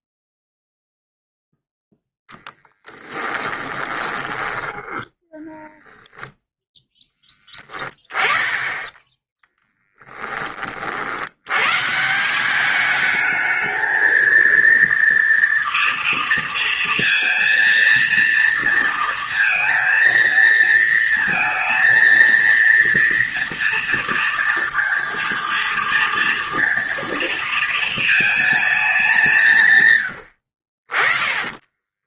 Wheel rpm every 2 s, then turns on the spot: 0, 20, 10, 10, 10, 60, 210, 230, 230, 230, 220, 240, 230, 230, 210, 50.
2-6 8-10